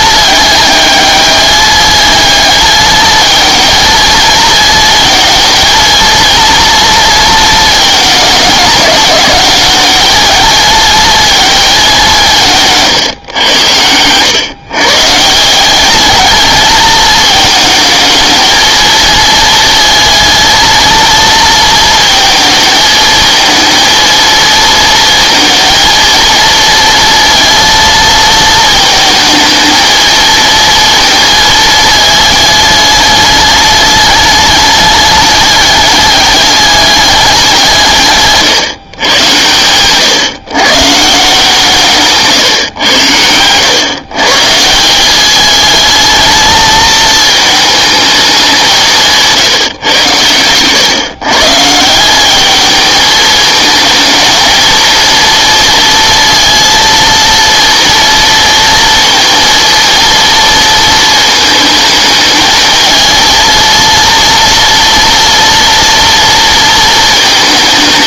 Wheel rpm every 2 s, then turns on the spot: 210, 220, 220, 230, 220, 230, 160, 130, 210, 220, 230, 230, 230, 220, 220, 230, 210, 210, 200, 140, 140, 130, 150, 220, 190, 120, 210, 220, 230, 230, 230, 220, 230, 230.
none